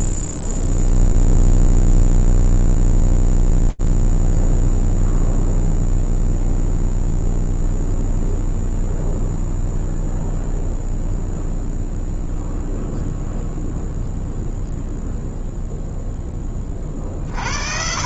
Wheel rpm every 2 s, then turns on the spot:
0, 0, 0, 0, 0, 0, 0, 0, 30.
none